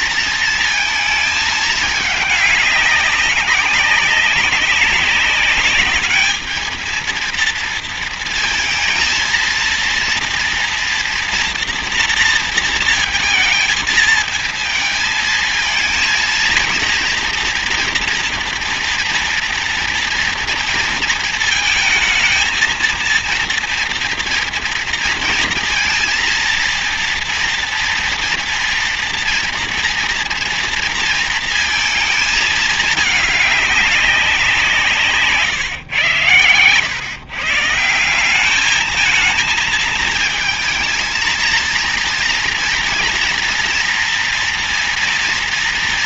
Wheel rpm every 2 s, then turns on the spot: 230, 210, 200, 210, 230, 230, 230, 230, 230, 240, 230, 220, 230, 230, 230, 230, 220, 190, 110, 190, 220, 230, 230.
none